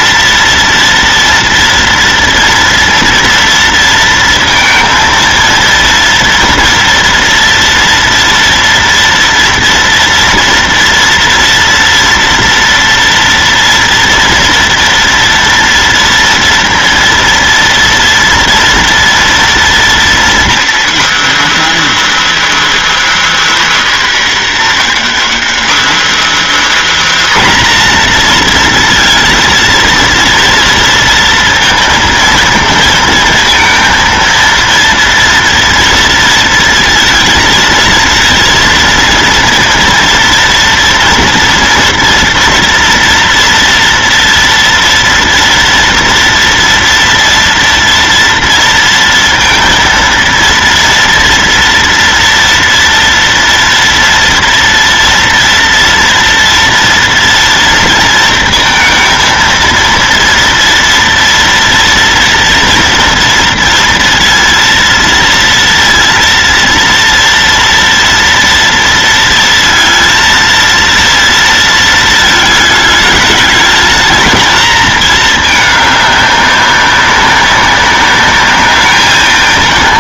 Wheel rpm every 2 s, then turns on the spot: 230, 230, 230, 230, 230, 230, 230, 230, 230, 230, 250, 340, 290, 320, 240, 230, 230, 230, 230, 230, 230, 230, 240, 230, 230, 230, 230, 240, 230, 230, 230, 230, 230, 230, 230, 230, 220, 220, 200, 200.
none